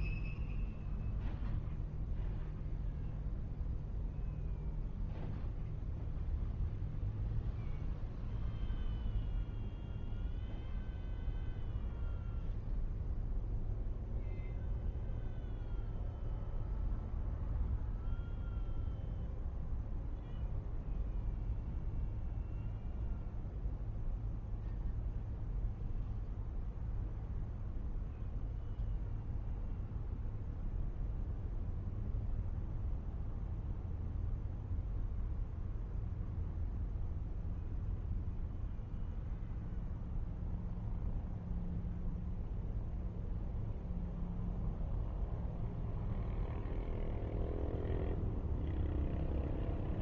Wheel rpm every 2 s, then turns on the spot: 0, 0, 0, 0, 0, 0, 0, 0, 0, 0, 0, 0, 0, 0, 0, 0, 0, 0, 0, 0, 0, 0, 0, 0, 0.
none